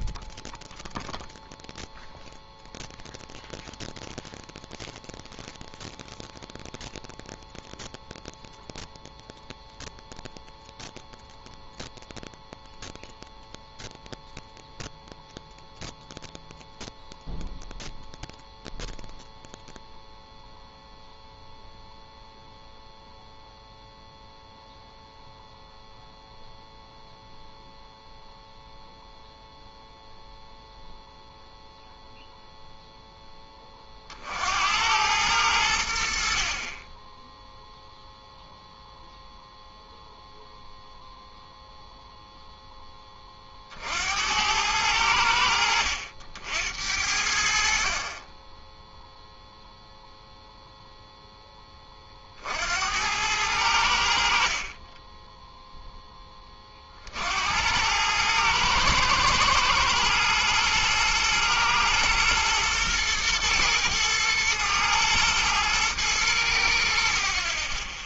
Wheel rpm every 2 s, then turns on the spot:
0, 0, 0, 0, 0, 0, 0, 0, 0, 0, 0, 0, 0, 0, 0, 0, 0, 90, 20, 0, 0, 10, 100, 70, 0, 0, 80, 30, 60, 110, 120, 110, 110, 70.
none